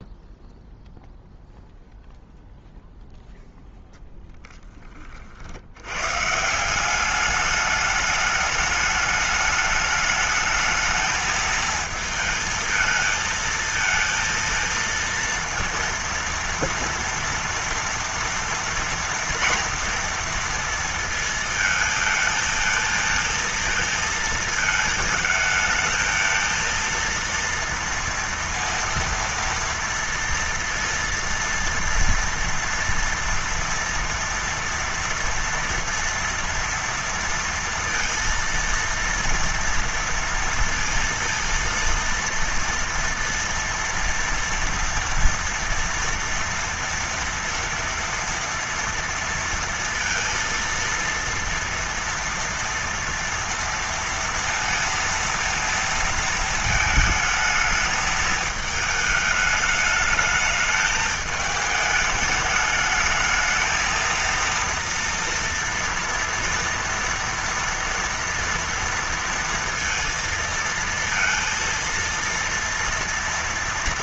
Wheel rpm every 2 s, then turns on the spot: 0, 0, 20, 190, 210, 220, 220, 230, 230, 230, 230, 220, 220, 230, 230, 230, 230, 230, 230, 230, 230, 230, 230, 230, 230, 230, 230, 230, 220, 220, 220, 220, 230, 230, 230, 230, 230.
none